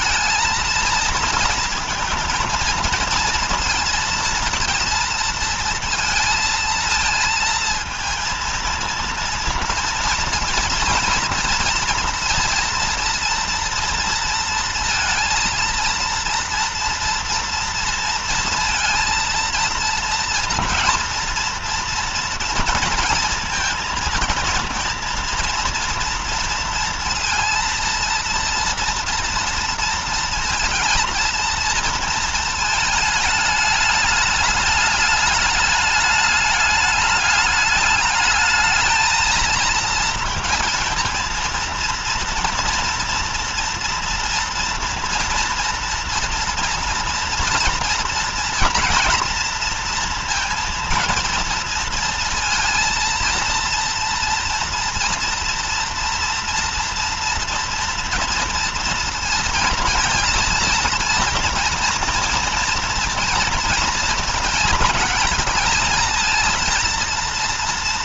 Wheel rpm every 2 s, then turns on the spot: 230, 230, 230, 230, 230, 230, 230, 230, 230, 230, 230, 230, 230, 230, 230, 230, 220, 210, 210, 220, 230, 230, 230, 230, 240, 230, 230, 230, 240, 230, 230, 230, 220, 230.
none